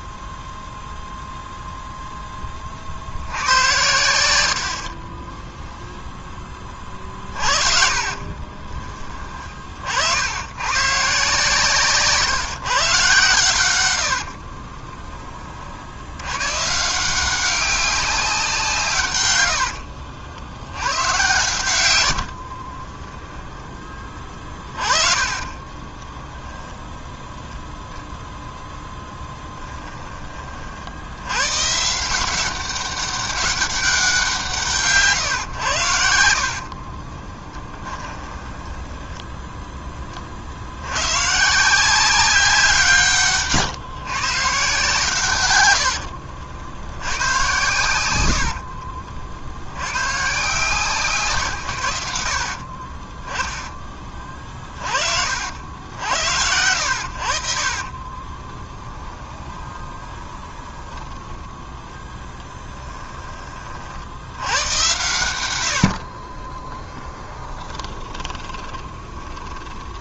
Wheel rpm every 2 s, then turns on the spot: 0, 50, 40, 30, 30, 130, 130, 30, 150, 160, 100, 30, 30, 0, 10, 70, 190, 140, 50, 10, 100, 160, 140, 80, 50, 160, 40, 40, 80, 10, 20, 10, 100, 10, 30.
4-10 14-16 22-26 36-40 52-54 58-62 66-70